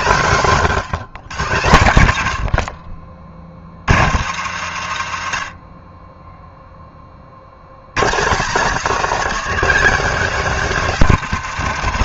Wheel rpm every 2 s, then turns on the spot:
170, 70, 120, 10, 220, 240.
none